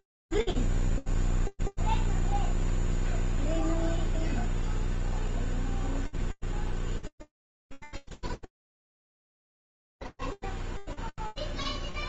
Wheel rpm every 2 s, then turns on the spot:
0, 0, 0, 0, 0, 0.
none